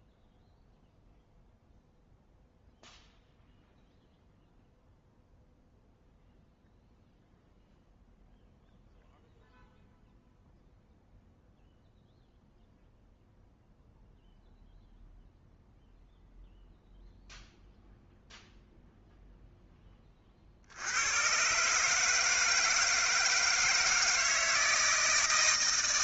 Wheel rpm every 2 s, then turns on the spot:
0, 0, 0, 0, 0, 0, 0, 0, 0, 0, 60, 160, 160.
none